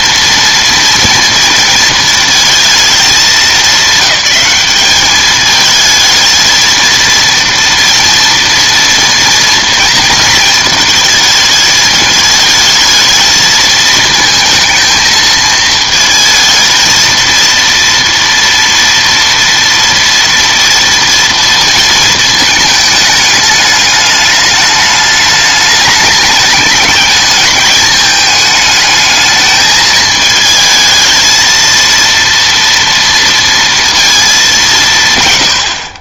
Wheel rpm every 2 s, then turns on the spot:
230, 220, 200, 230, 230, 230, 220, 230, 220, 230, 230, 220, 210, 210, 210, 220, 230, 190.
none